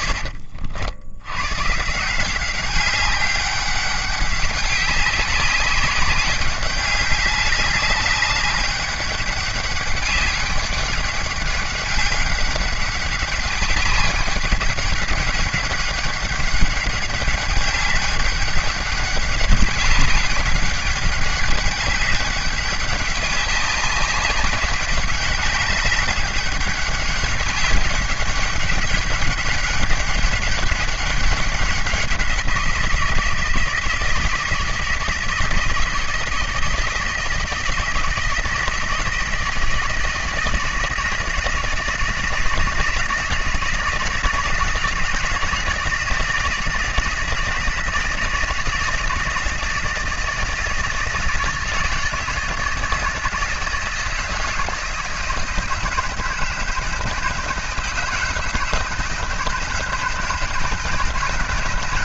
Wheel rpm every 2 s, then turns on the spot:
70, 190, 190, 200, 200, 200, 200, 200, 200, 200, 200, 200, 200, 200, 200, 200, 170, 160, 170, 170, 160, 160, 170, 170, 160, 170, 170, 160, 170, 160, 160.
none